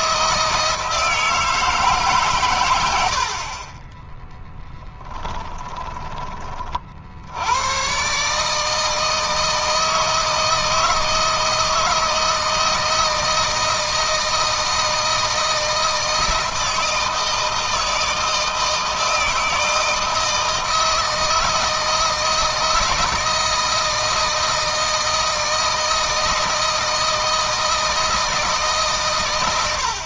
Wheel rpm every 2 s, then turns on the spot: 160, 100, 10, 50, 150, 160, 160, 160, 160, 160, 160, 160, 170, 160, 150.
2-6